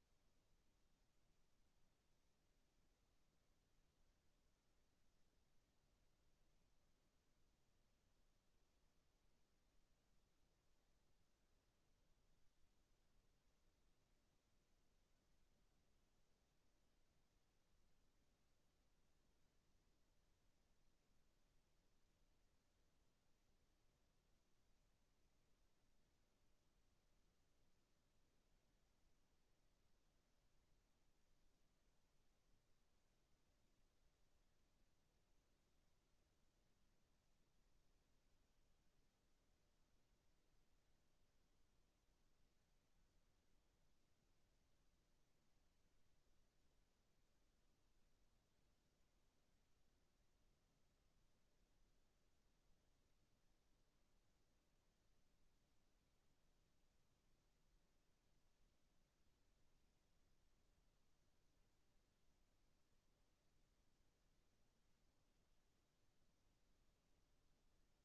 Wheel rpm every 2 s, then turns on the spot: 0, 0, 0, 0, 0, 0, 0, 0, 0, 0, 0, 0, 0, 0, 0, 0, 0, 0, 0, 0, 0, 0, 0, 0, 0, 0, 0, 0, 0, 0, 0, 0, 0, 0.
none